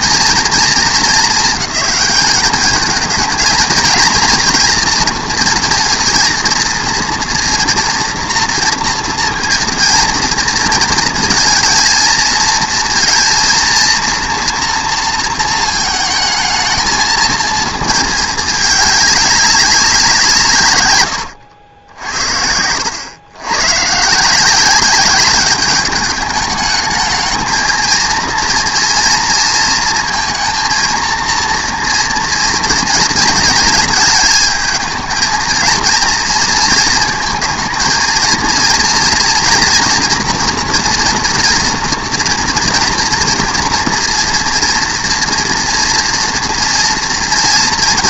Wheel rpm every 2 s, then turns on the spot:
230, 210, 230, 230, 230, 230, 220, 230, 220, 210, 130, 80, 180, 210, 230, 230, 230, 220, 240, 230, 230, 240, 230, 230.
none